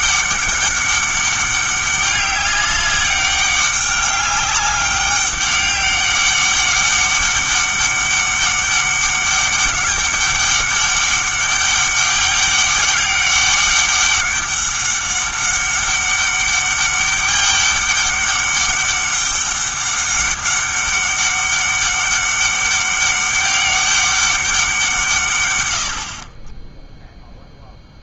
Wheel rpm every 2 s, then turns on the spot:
200, 200, 200, 200, 200, 200, 200, 200, 200, 200, 200, 200, 180, 10.
none